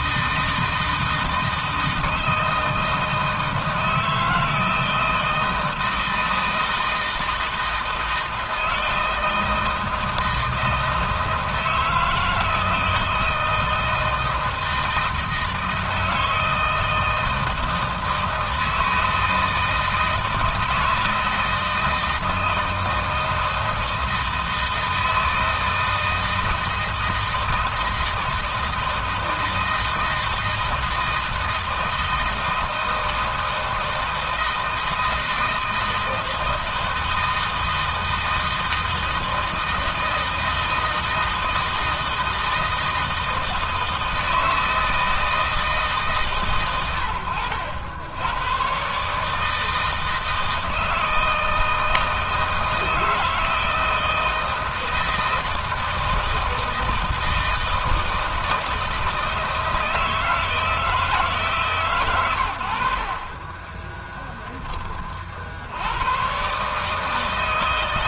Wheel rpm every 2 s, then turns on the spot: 160, 160, 160, 160, 160, 160, 160, 160, 160, 160, 160, 160, 160, 160, 160, 160, 160, 160, 160, 160, 160, 160, 160, 110, 130, 160, 160, 160, 160, 160, 160, 80, 20, 150.
none